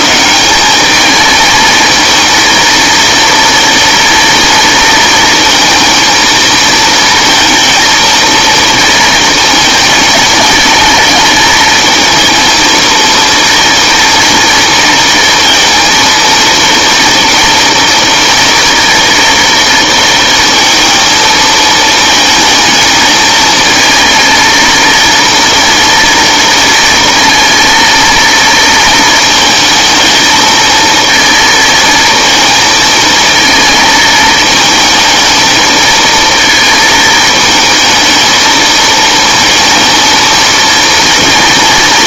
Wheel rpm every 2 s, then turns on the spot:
190, 230, 230, 230, 230, 220, 230, 230, 230, 230, 230, 220, 230, 230, 230, 220, 230, 220, 230, 220, 230.
none